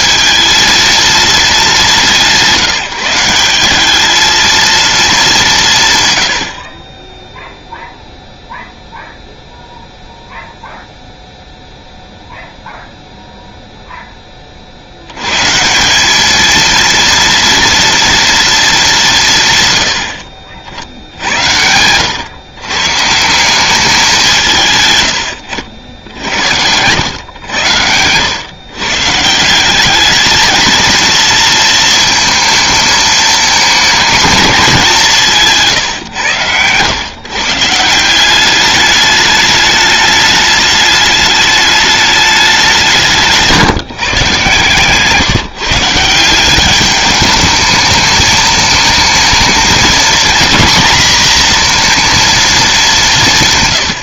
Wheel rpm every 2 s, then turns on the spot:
220, 170, 220, 40, 0, 0, 0, 40, 230, 220, 60, 130, 160, 90, 130, 220, 220, 210, 110, 200, 210, 190, 140, 200, 220, 230, 210.
none